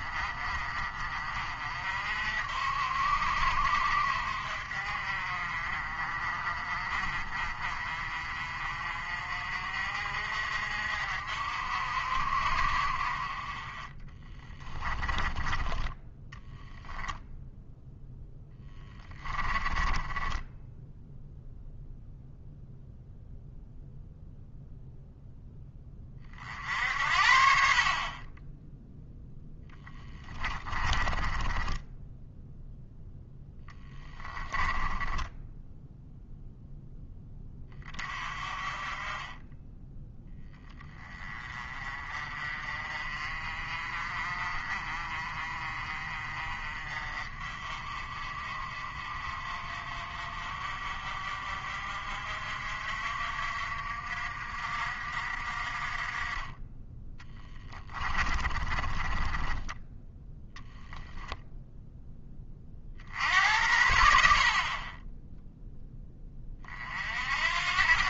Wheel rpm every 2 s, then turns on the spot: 30, 60, 50, 40, 40, 50, 40, 20, 0, 10, 0, 0, 0, 60, 10, 20, 0, 10, 0, 30, 20, 40, 40, 40, 40, 50, 60, 60, 20, 30, 0, 50, 30, 40.
14-16 18-20 30-32 34-36 58-60